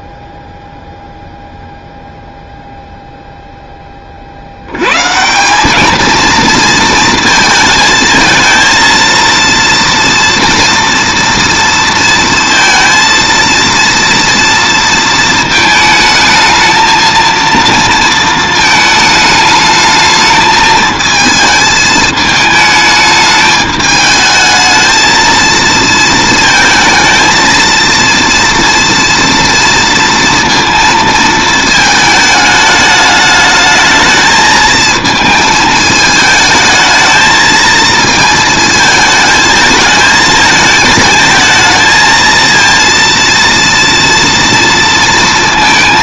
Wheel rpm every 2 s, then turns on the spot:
0, 0, 90, 230, 230, 230, 230, 230, 220, 220, 220, 220, 220, 220, 230, 230, 210, 220, 220, 220, 220, 230, 230.
none